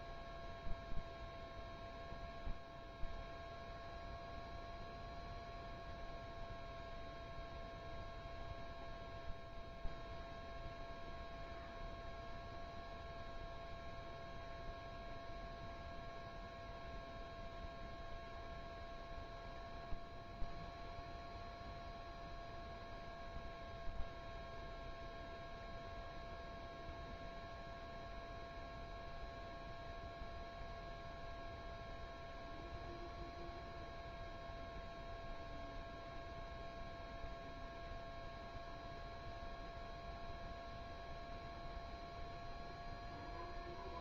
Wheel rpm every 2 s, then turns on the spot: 0, 0, 0, 0, 0, 0, 0, 0, 0, 0, 0, 0, 0, 0, 0, 0, 0, 0, 0, 0, 0, 0.
none